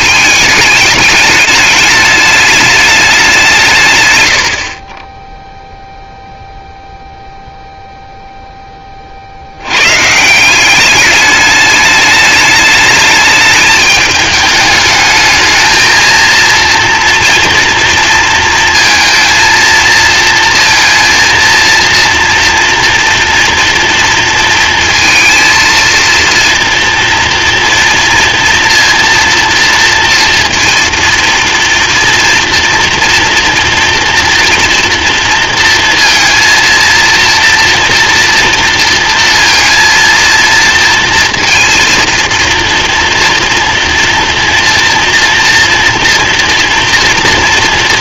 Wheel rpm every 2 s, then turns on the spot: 210, 210, 60, 0, 20, 190, 210, 210, 230, 230, 230, 230, 230, 230, 230, 230, 240, 230, 230, 230, 230, 230, 240, 230.
none